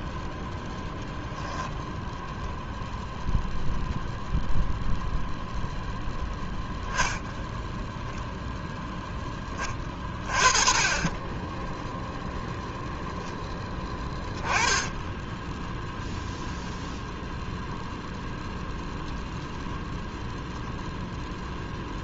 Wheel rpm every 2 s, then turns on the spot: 0, 0, 0, 10, 0, 40, 0, 10, 0, 0, 0.
none